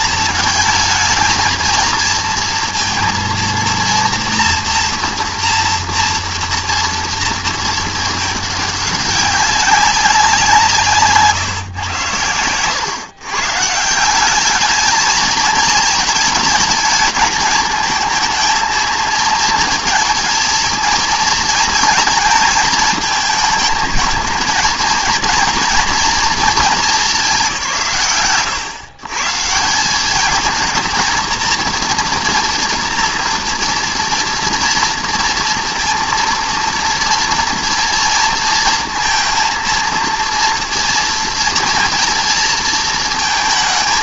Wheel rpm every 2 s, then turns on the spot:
220, 230, 230, 230, 200, 160, 120, 210, 220, 220, 230, 220, 220, 220, 120, 230, 240, 230, 230, 230, 230, 230.
none